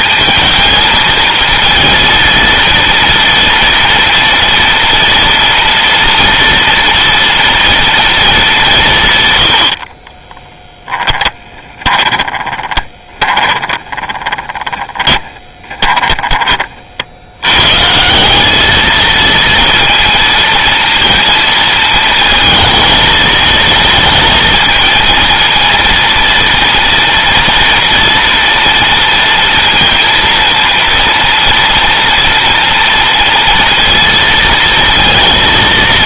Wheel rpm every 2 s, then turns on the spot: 220, 230, 230, 240, 160, 10, 20, 20, 50, 220, 230, 230, 230, 230, 230, 230, 230, 230.
10-16